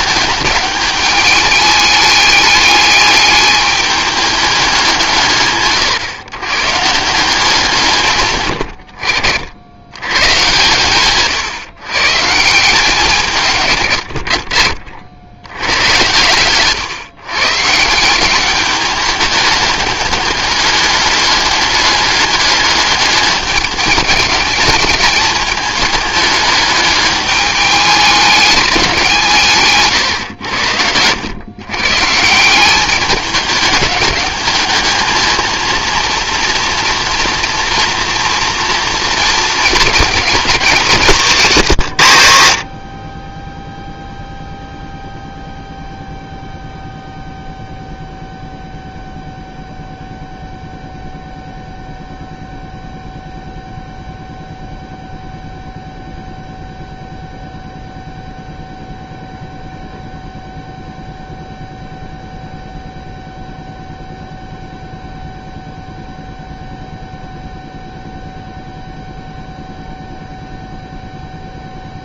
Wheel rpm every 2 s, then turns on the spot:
210, 210, 190, 140, 80, 130, 160, 70, 130, 210, 200, 200, 210, 210, 190, 80, 190, 210, 230, 230, 190, 50, 0, 0, 0, 0, 0, 0, 0, 0, 0, 0, 0, 0, 0, 0.
none